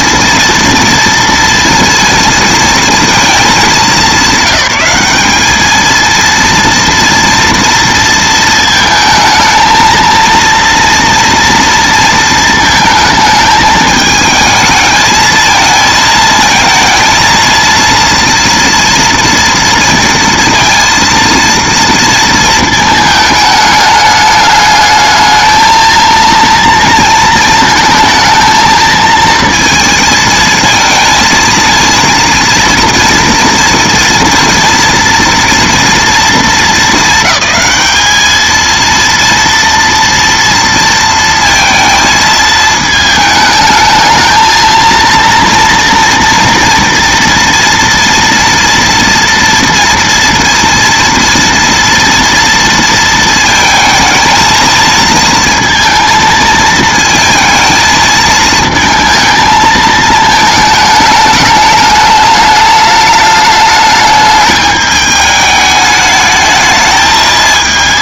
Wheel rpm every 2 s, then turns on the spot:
230, 230, 200, 230, 220, 230, 220, 220, 230, 230, 230, 220, 210, 230, 220, 220, 230, 230, 230, 220, 230, 220, 220, 230, 230, 230, 230, 230, 220, 220, 220, 210, 210, 210.
none